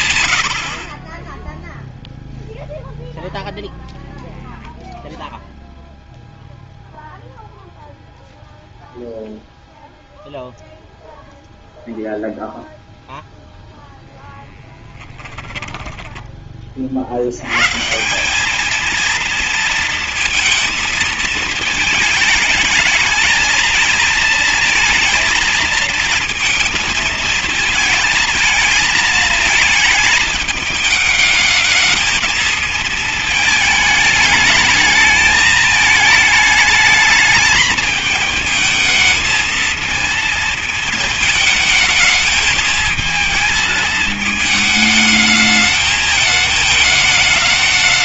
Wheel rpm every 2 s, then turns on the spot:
20, 0, 0, 0, 0, 0, 0, 20, 60, 220, 230, 220, 220, 220, 220, 220, 220, 220, 220, 230, 220, 220, 220, 210.
14-16